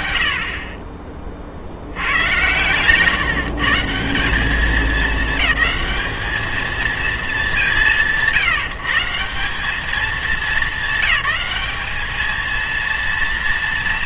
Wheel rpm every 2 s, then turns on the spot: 60, 120, 210, 220, 160, 210, 230.
none